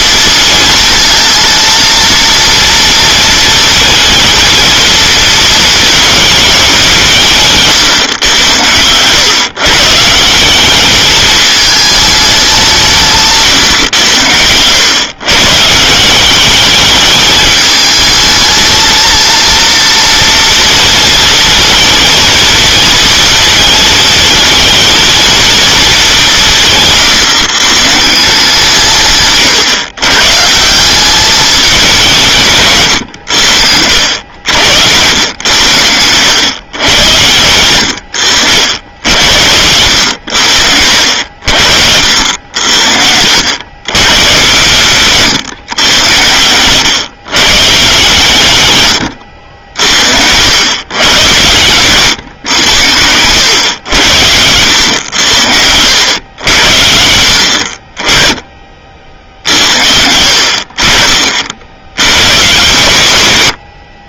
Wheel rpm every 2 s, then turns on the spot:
230, 230, 230, 200, 110, 210, 170, 110, 210, 220, 230, 220, 230, 140, 170, 180, 130, 90, 100, 70, 70, 70, 130, 120, 100, 100, 100, 90, 70, 30, 40, 110.
none